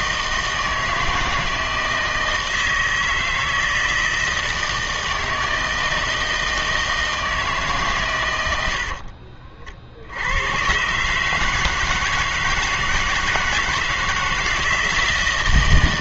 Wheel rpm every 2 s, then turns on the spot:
160, 160, 160, 160, 80, 120, 160, 160.
none